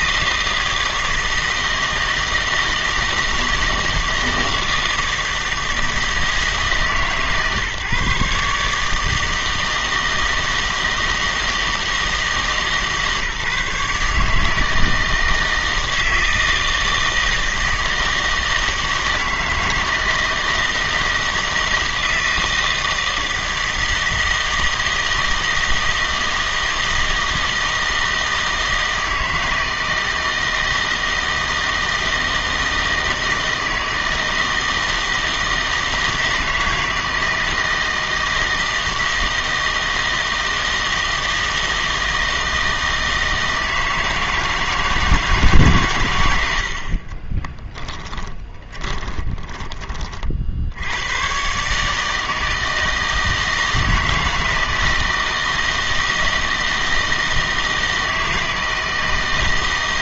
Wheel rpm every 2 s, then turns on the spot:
160, 160, 160, 150, 150, 160, 150, 160, 160, 160, 160, 160, 160, 160, 160, 160, 160, 160, 160, 160, 160, 160, 160, 70, 30, 70, 160, 160, 160, 160.
48-50